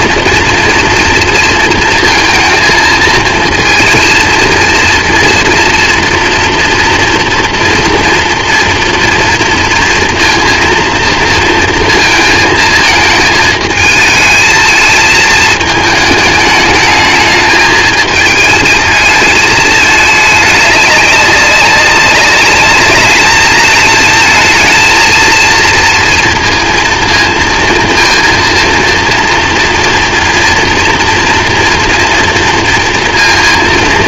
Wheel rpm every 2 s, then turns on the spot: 230, 230, 230, 230, 230, 230, 220, 220, 210, 220, 210, 210, 230, 230, 230, 230, 230.
none